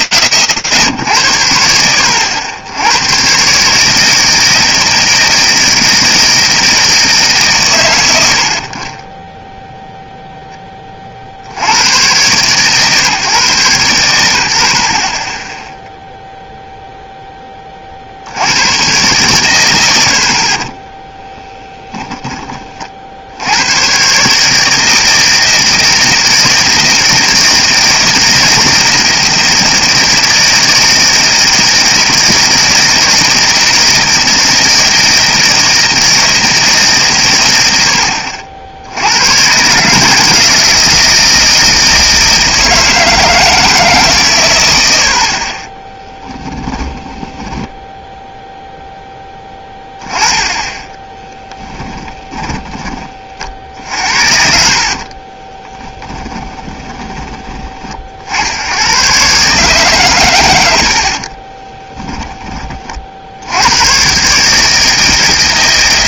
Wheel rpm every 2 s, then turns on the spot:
40, 80, 160, 160, 90, 20, 140, 70, 0, 100, 10, 50, 160, 160, 160, 160, 160, 170, 160, 70, 160, 160, 70, 20, 0, 10, 20, 50, 20, 90, 100, 20, 150.
20-22 46-48 54-58